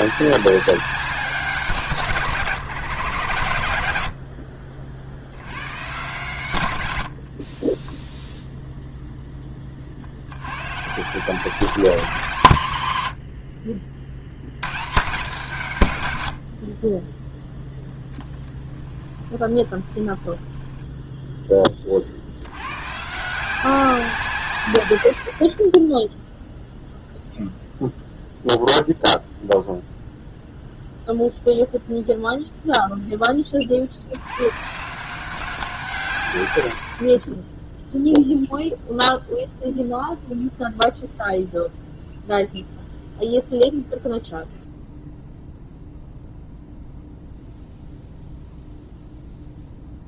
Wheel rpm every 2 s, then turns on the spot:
190, 140, 60, 120, 0, 110, 130, 110, 50, 20, 10, 100, 130, 0, 0, 0, 0, 120, 90, 0, 0, 0, 0, 0, 0.
18-22